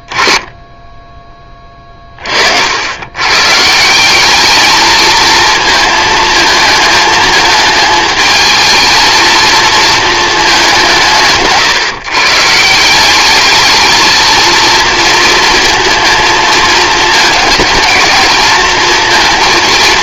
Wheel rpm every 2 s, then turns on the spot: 10, 50, 200, 230, 220, 190, 150, 230, 230, 220.
none